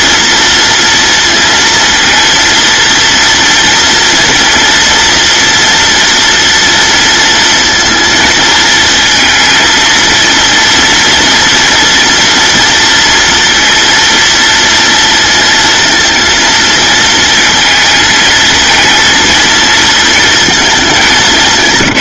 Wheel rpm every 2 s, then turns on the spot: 230, 230, 230, 230, 220, 230, 230, 230, 230, 220, 200.
none